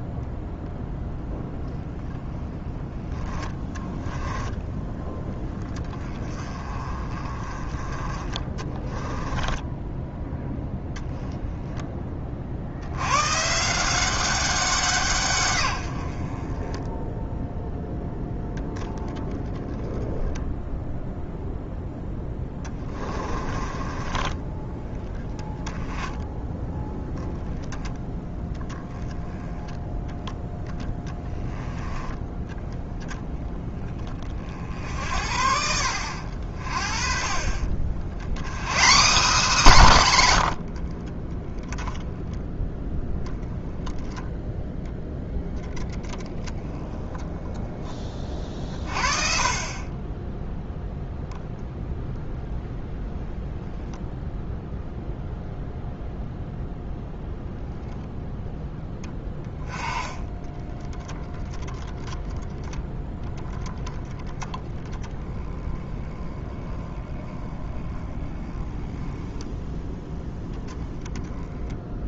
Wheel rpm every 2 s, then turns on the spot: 0, 10, 10, 30, 20, 10, 80, 170, 10, 10, 0, 20, 20, 10, 10, 10, 0, 60, 40, 180, 30, 10, 0, 10, 40, 0, 0, 0, 0, 10, 10, 0, 20, 10, 10, 20.
8-10 22-24